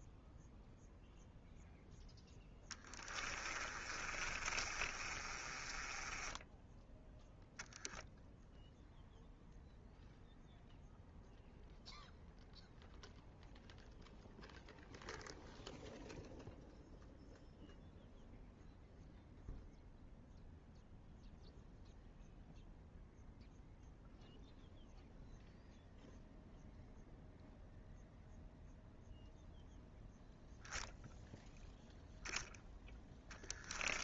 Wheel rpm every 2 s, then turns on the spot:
0, 10, 30, 0, 0, 0, 0, 0, 0, 0, 0, 0, 0, 0, 0, 0, 10.
2-6